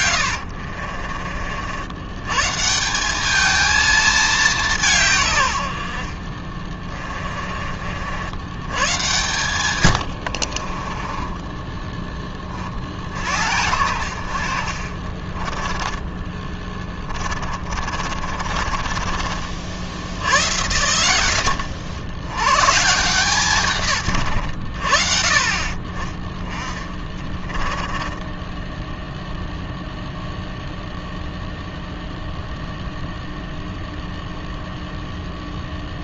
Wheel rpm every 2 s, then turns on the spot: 60, 160, 190, 30, 100, 40, 40, 50, 20, 30, 90, 130, 70, 20, 10, 0, 0, 0.
0-2 6-8 10-12 16-20 26-28